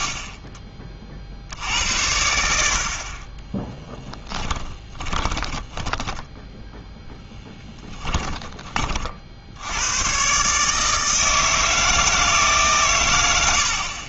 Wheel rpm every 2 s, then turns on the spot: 30, 70, 20, 10, 20, 140, 140.
4-8